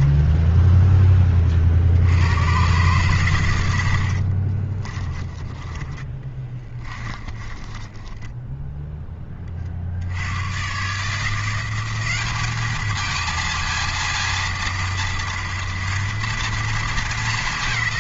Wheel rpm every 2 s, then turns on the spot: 10, 120, 20, 20, 10, 150, 220, 230, 220.
4-8